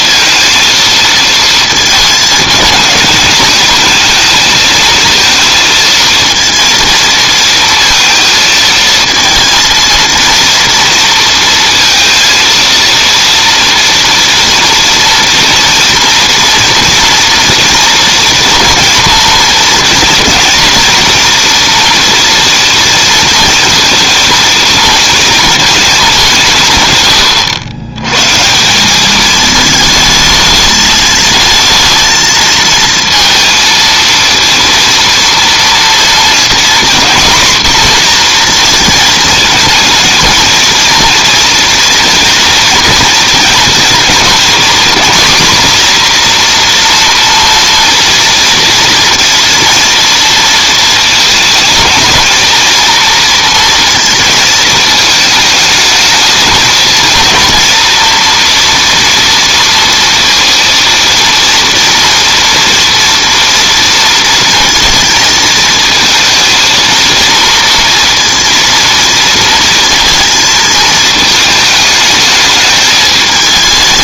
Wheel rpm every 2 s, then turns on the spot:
230, 210, 220, 230, 220, 230, 230, 240, 230, 230, 230, 230, 220, 130, 180, 220, 230, 230, 240, 230, 230, 230, 250, 240, 230, 230, 230, 220, 220, 230, 230, 230, 230, 230, 230, 230, 210.
none